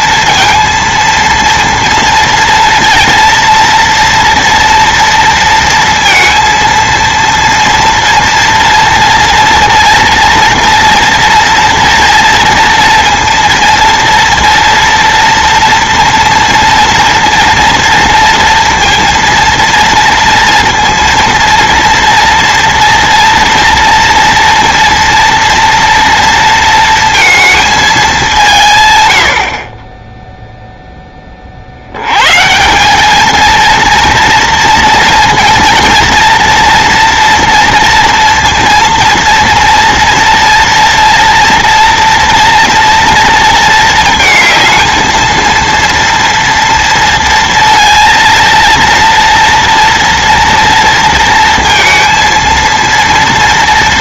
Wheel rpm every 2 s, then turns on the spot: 230, 230, 230, 230, 230, 230, 230, 230, 230, 230, 230, 230, 240, 230, 120, 0, 190, 230, 230, 230, 230, 230, 220, 230, 230, 230, 230.
none